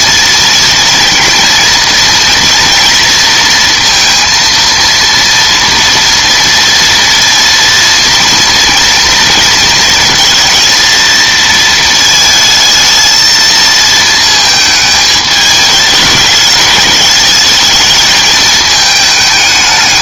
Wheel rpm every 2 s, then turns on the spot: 230, 230, 230, 230, 230, 230, 220, 220, 210, 220.
none